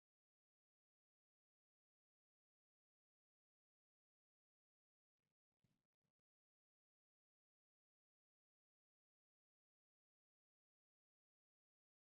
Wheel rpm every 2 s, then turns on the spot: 0, 0, 0, 0, 0, 0.
none